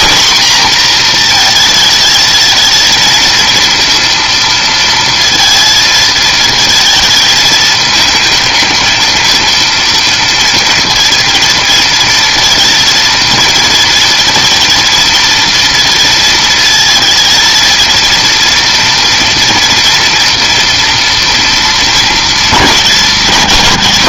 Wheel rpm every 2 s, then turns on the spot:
240, 220, 230, 220, 220, 230, 230, 230, 230, 240, 240, 220.
none